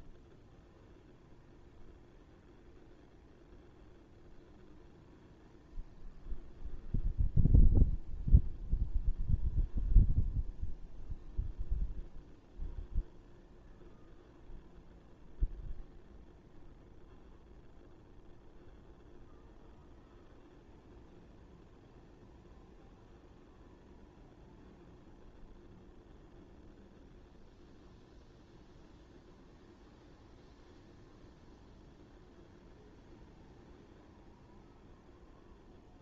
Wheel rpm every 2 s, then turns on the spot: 0, 0, 0, 0, 0, 0, 0, 0, 0, 0, 0, 0, 0, 0, 0, 0, 0, 0.
none